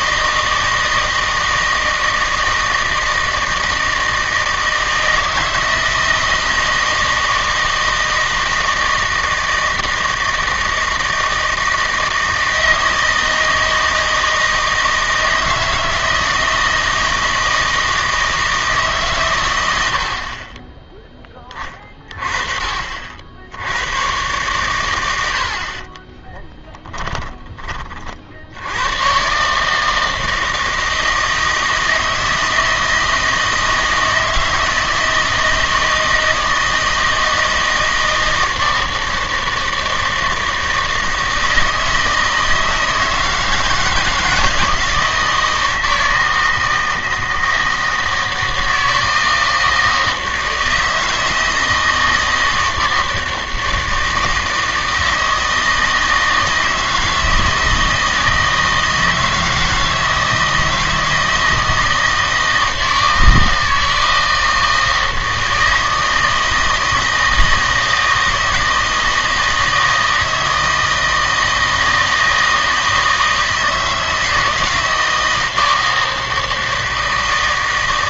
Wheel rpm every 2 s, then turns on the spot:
160, 160, 160, 160, 160, 160, 160, 160, 160, 150, 20, 40, 110, 10, 90, 160, 160, 160, 160, 160, 160, 160, 160, 160, 160, 160, 160, 160, 160, 160, 160, 160, 160, 160, 160, 160, 160, 160, 160.
26-28